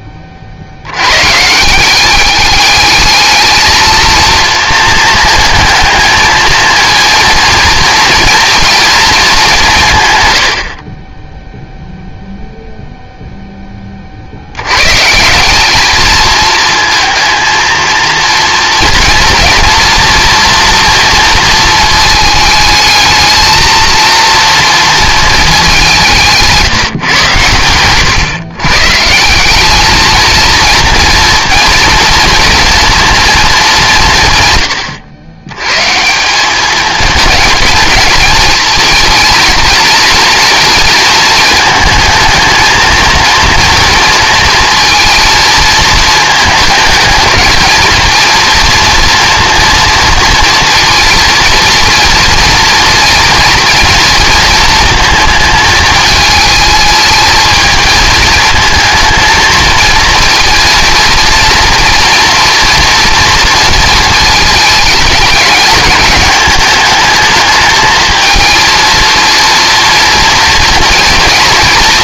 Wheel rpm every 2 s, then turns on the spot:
60, 200, 230, 230, 230, 90, 0, 120, 220, 230, 230, 220, 230, 160, 130, 230, 230, 120, 190, 220, 230, 220, 230, 220, 230, 240, 230, 230, 220, 220, 230, 240, 220, 210, 220, 230.
26-28